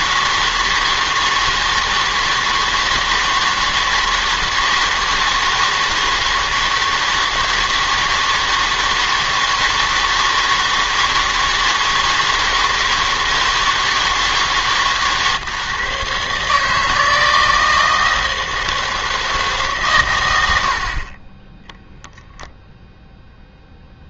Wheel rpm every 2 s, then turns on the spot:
160, 160, 160, 160, 160, 160, 160, 160, 150, 160, 80, 0.
none